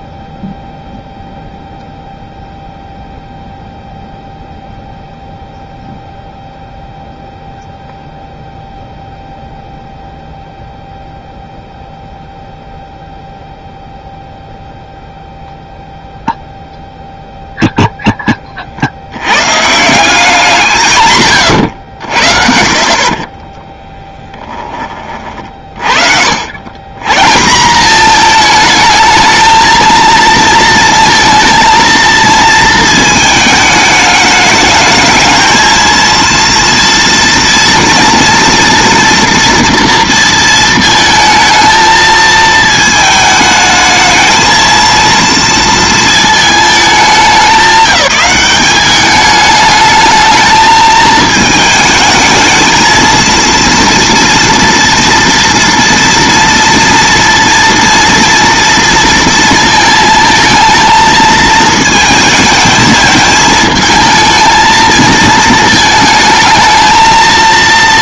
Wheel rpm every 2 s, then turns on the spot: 0, 0, 0, 0, 0, 0, 0, 0, 0, 40, 180, 50, 10, 100, 220, 230, 230, 210, 230, 230, 230, 220, 230, 210, 200, 220, 220, 230, 230, 230, 220, 220, 220, 220.
none